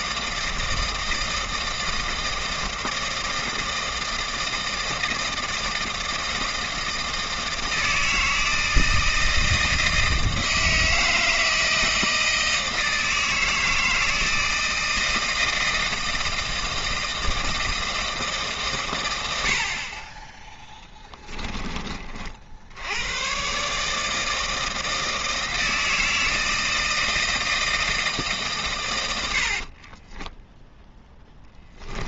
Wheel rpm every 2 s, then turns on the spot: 160, 160, 160, 160, 160, 160, 160, 160, 160, 130, 10, 80, 160, 160, 120, 0.
20-22